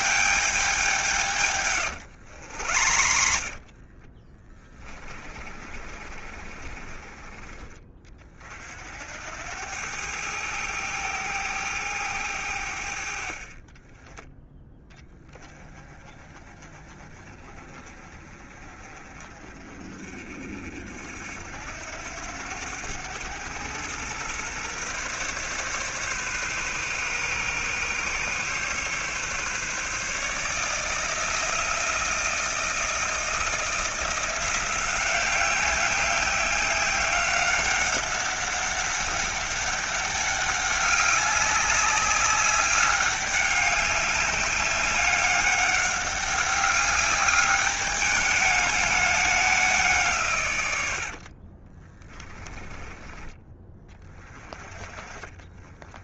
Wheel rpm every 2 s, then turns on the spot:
180, 60, 30, 30, 70, 110, 70, 10, 30, 40, 60, 100, 130, 130, 140, 160, 170, 180, 190, 200, 200, 200, 200, 200, 210, 90, 20, 30.
2-8